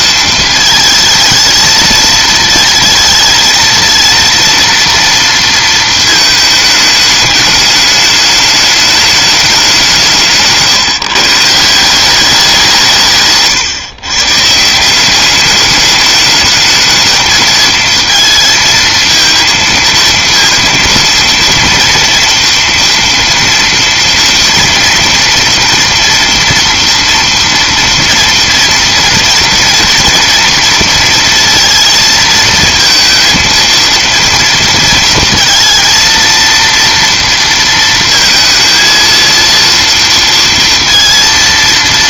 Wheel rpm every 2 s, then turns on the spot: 220, 220, 230, 210, 210, 150, 180, 170, 220, 230, 230, 230, 230, 230, 230, 230, 230, 230, 230, 230, 230.
10-12